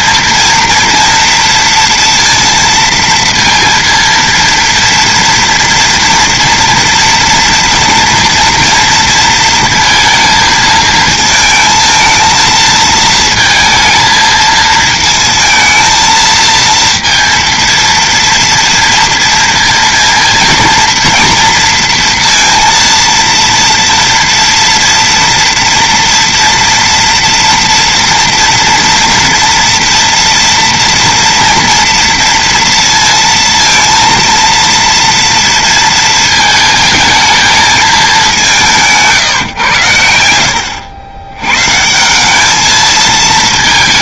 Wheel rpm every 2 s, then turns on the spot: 230, 230, 230, 230, 230, 230, 220, 220, 230, 230, 230, 230, 230, 230, 230, 230, 230, 230, 230, 170, 80, 220.
none